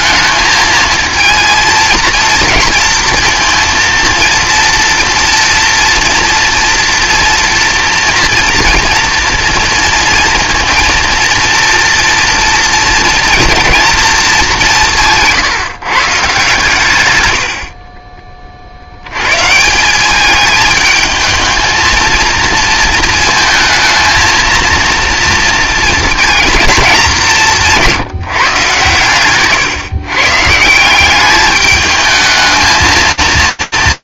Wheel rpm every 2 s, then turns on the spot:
220, 230, 230, 230, 230, 230, 230, 180, 130, 60, 220, 230, 230, 210, 130, 150, 220.
none